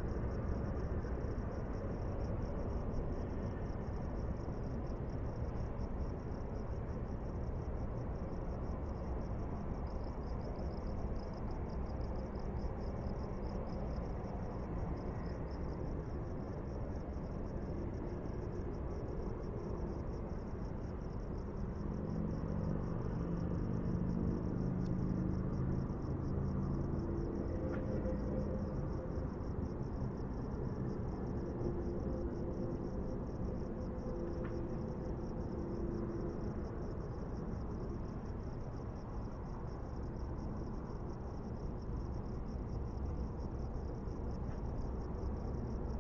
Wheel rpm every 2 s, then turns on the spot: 0, 0, 0, 0, 0, 0, 0, 0, 0, 0, 0, 0, 0, 0, 0, 0, 0, 0, 0, 0, 0, 0, 0.
none